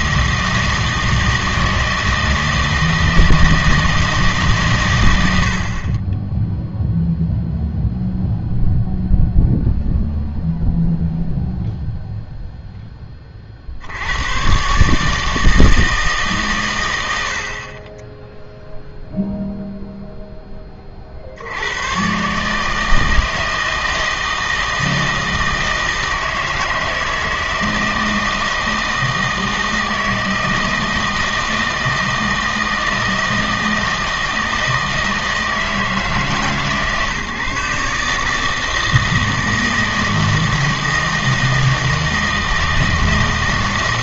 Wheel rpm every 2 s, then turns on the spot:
160, 160, 130, 0, 0, 0, 0, 130, 120, 0, 20, 150, 160, 160, 160, 160, 160, 160, 140, 160, 160, 160.
none